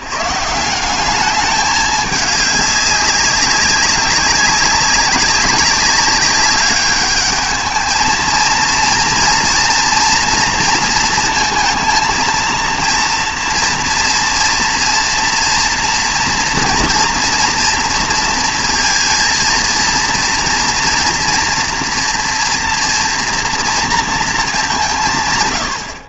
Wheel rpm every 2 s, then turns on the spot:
150, 200, 190, 200, 230, 230, 230, 230, 240, 230, 230, 240, 180.
none